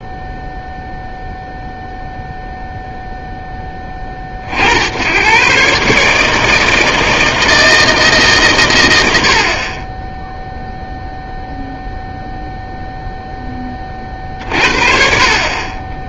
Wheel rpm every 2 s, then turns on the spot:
0, 0, 60, 160, 110, 0, 0, 50.
none